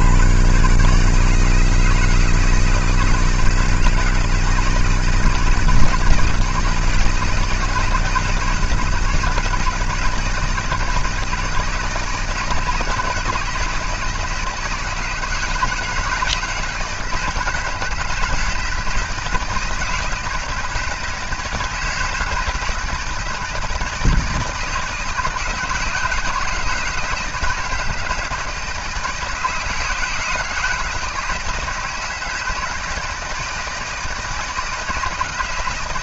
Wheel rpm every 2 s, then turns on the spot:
80, 160, 160, 160, 160, 150, 160, 160, 160, 160, 160, 160, 160, 150, 160, 160, 160, 160.
none